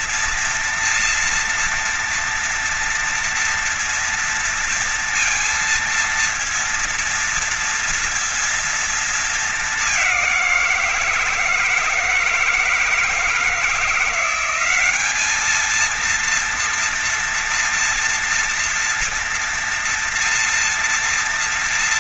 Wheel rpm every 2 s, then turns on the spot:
230, 230, 230, 230, 220, 180, 160, 200, 240, 230, 230.
none